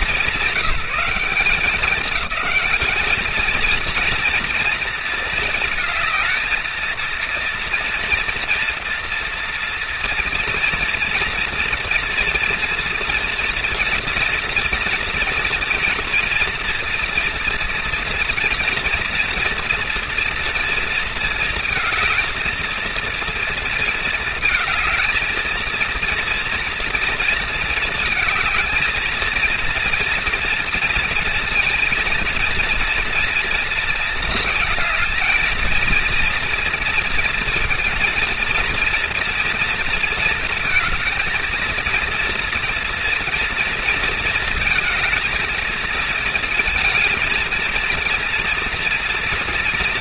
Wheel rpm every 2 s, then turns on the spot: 210, 230, 220, 230, 230, 240, 240, 230, 230, 230, 220, 230, 230, 220, 230, 230, 220, 230, 230, 230, 230, 230, 230, 230, 230.
none